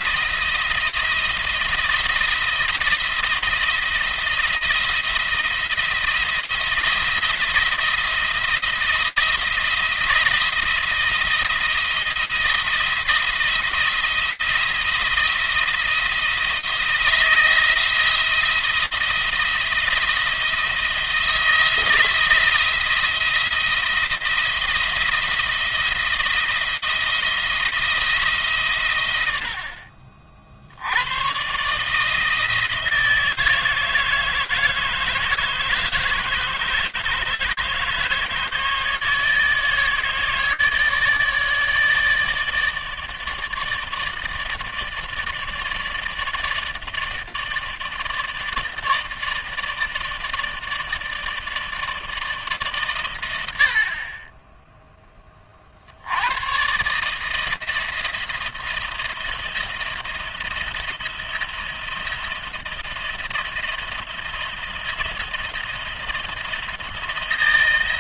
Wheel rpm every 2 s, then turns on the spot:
170, 170, 170, 170, 170, 170, 170, 170, 160, 170, 170, 170, 170, 160, 110, 90, 160, 160, 150, 160, 150, 150, 150, 150, 150, 160, 130, 10, 150, 170, 170, 160, 170, 170.
none